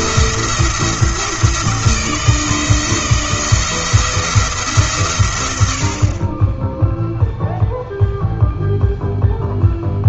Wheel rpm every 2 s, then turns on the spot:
170, 170, 110, 0, 0.
none